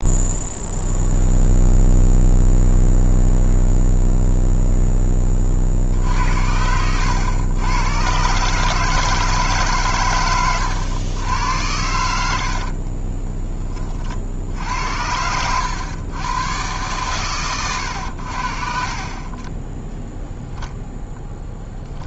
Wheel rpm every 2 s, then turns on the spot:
0, 0, 0, 80, 140, 110, 60, 70, 120, 50, 0.
12-14